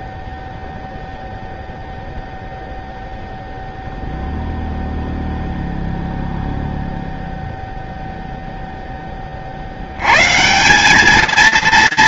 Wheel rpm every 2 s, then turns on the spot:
0, 0, 0, 0, 160, 230.
none